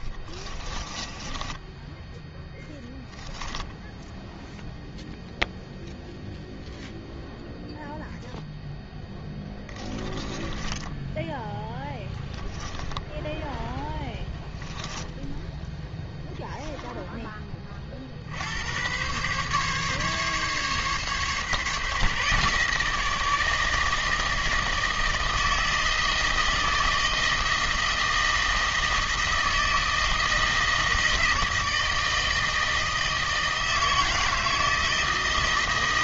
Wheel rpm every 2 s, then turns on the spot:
10, 0, 0, 0, 10, 10, 0, 0, 10, 130, 140, 160, 160, 160, 160, 160, 160, 160.
0-2 8-10